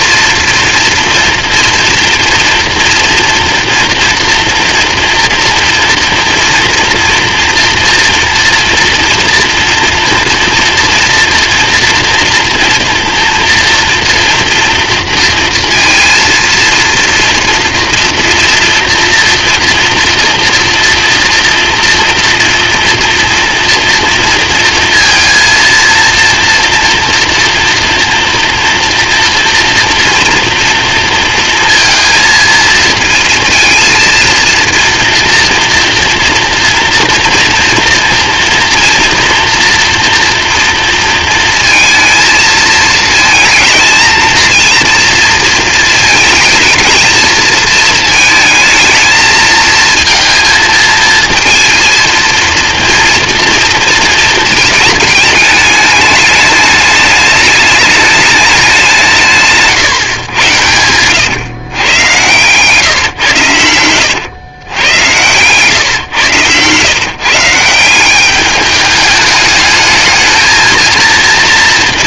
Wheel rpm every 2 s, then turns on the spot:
230, 230, 230, 230, 230, 230, 240, 230, 230, 230, 230, 240, 230, 230, 230, 230, 230, 230, 230, 230, 230, 220, 230, 220, 220, 220, 230, 210, 210, 180, 100, 140, 100, 130, 210, 230.
60-64